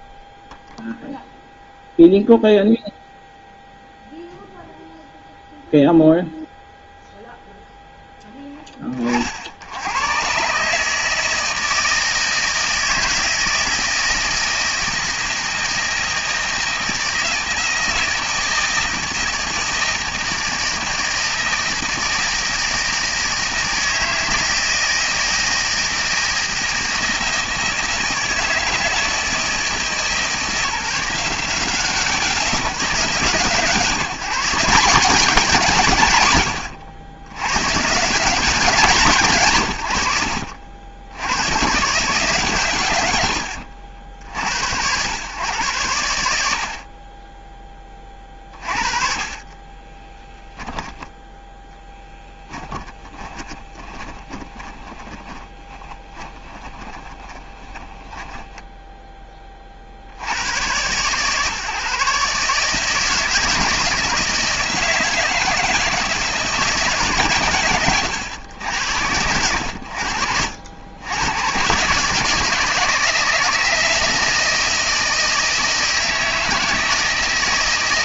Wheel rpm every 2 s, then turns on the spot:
0, 0, 0, 0, 30, 150, 160, 160, 160, 160, 160, 160, 160, 160, 160, 170, 160, 180, 80, 170, 80, 120, 90, 50, 30, 10, 20, 20, 20, 10, 120, 150, 160, 160, 90, 90, 160, 160, 160.
50-58